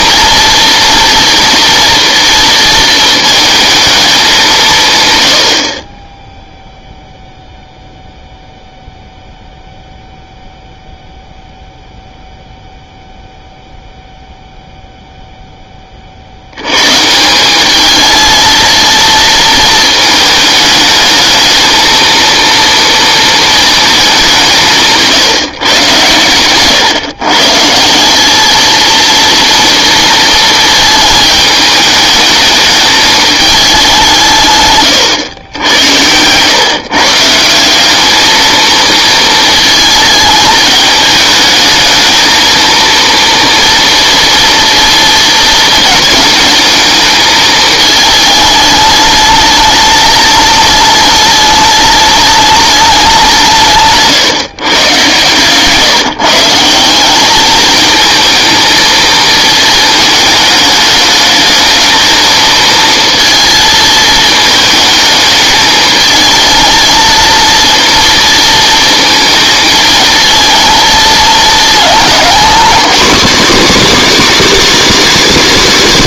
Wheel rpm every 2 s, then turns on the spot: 230, 230, 160, 0, 0, 0, 0, 0, 100, 230, 210, 230, 160, 120, 220, 230, 220, 140, 130, 220, 220, 220, 230, 220, 210, 210, 210, 130, 170, 220, 210, 220, 220, 220, 230, 230, 250, 300.
none